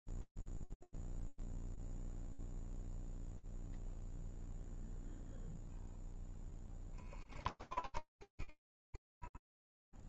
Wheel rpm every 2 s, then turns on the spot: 0, 0, 0, 10, 10.
none